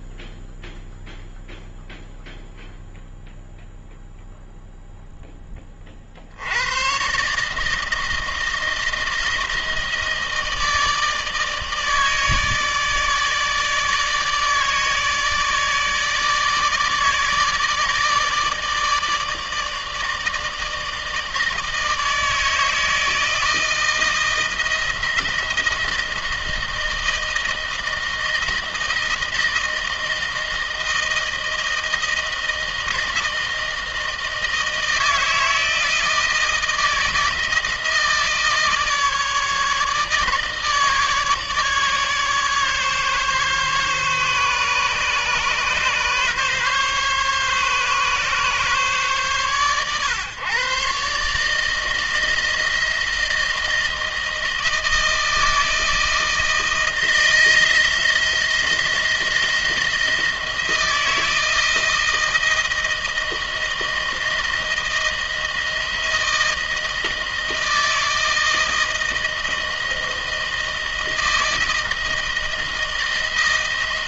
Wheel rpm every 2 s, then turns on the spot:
0, 0, 0, 110, 160, 160, 150, 160, 160, 150, 160, 160, 160, 160, 160, 160, 160, 160, 160, 160, 150, 140, 140, 140, 130, 140, 170, 160, 160, 170, 160, 160, 160, 160, 160, 160, 160.
none